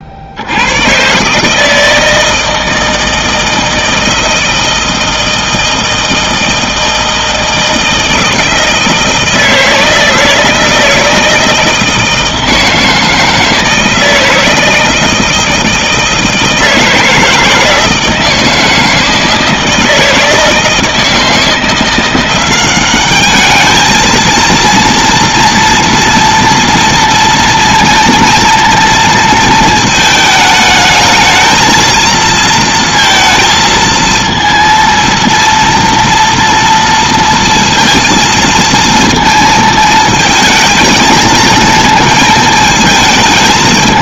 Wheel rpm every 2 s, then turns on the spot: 90, 160, 160, 160, 160, 160, 160, 160, 160, 160, 160, 180, 230, 230, 230, 220, 230, 230, 230, 230, 220, 220.
none